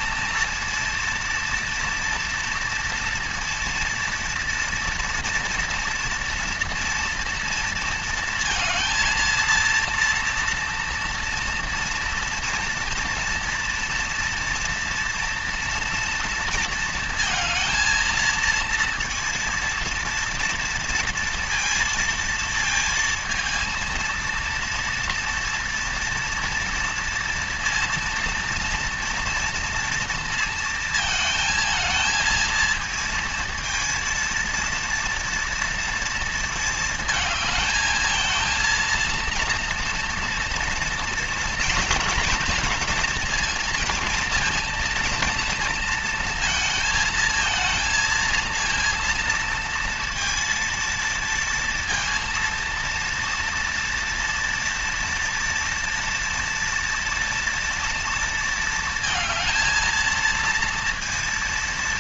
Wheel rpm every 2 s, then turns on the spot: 230, 230, 240, 230, 230, 230, 230, 230, 230, 230, 230, 230, 230, 230, 240, 230, 230, 230, 220, 230, 230, 230, 230, 220, 230, 230, 230, 230, 230, 220, 230.
none